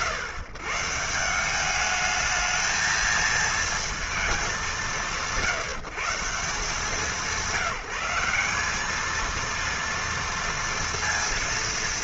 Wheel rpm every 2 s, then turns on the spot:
120, 220, 220, 150, 210, 230.
none